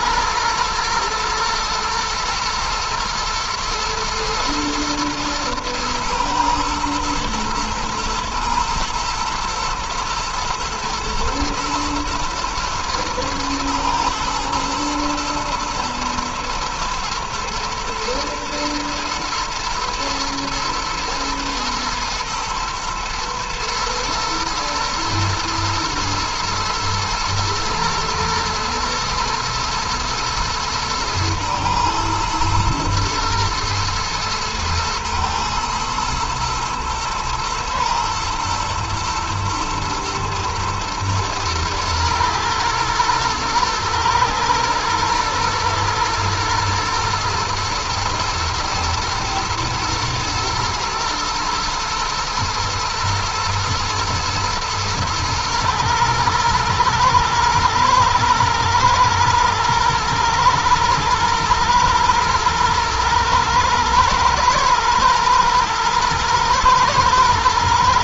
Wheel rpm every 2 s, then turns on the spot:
110, 110, 120, 110, 120, 120, 110, 110, 120, 110, 110, 120, 120, 120, 110, 110, 110, 110, 110, 120, 110, 110, 110, 120, 110, 110, 110, 110, 110, 110, 120, 110, 110, 110.
none